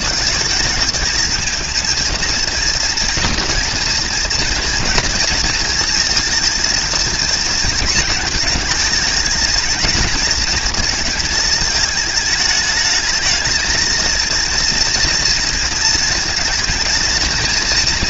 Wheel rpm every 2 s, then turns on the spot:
220, 230, 230, 220, 220, 220, 210, 230, 230.
none